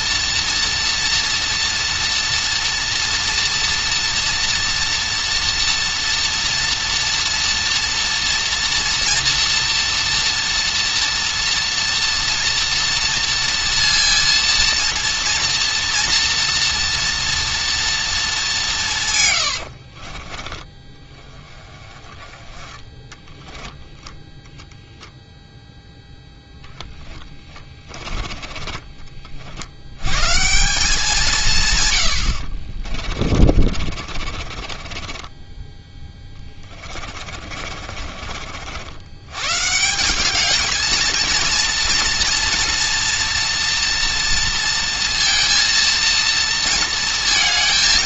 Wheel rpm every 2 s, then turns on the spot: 240, 240, 230, 230, 230, 230, 230, 230, 230, 190, 20, 20, 0, 10, 20, 170, 50, 30, 20, 60, 210, 240, 230, 230.
28-30 32-38